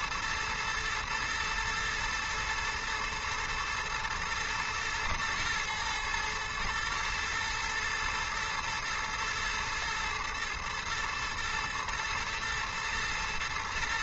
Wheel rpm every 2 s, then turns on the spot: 120, 110, 120, 120, 110, 110, 110.
none